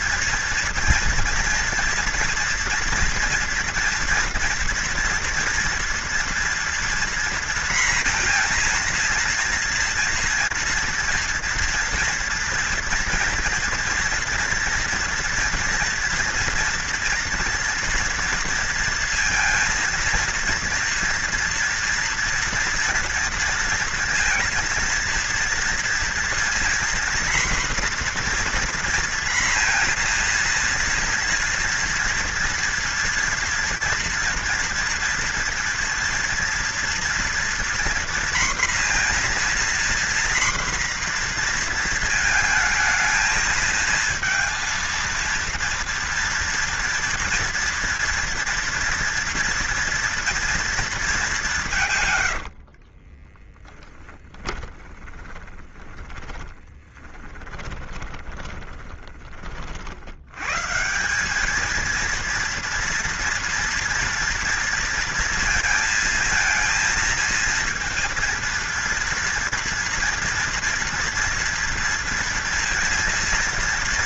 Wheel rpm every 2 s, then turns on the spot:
230, 240, 240, 230, 230, 230, 230, 230, 230, 230, 230, 240, 230, 240, 240, 240, 240, 230, 240, 240, 240, 220, 230, 230, 230, 230, 90, 30, 10, 20, 130, 230, 240, 230, 230, 230, 240.
52-60